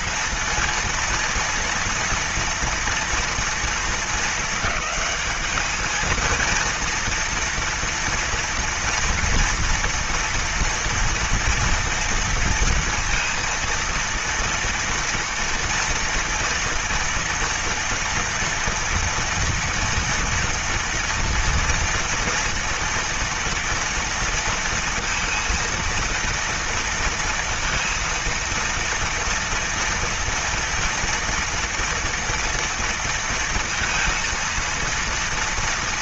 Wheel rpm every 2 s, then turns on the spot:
230, 230, 210, 230, 230, 230, 230, 230, 230, 240, 230, 230, 230, 230, 230, 230, 230, 230.
none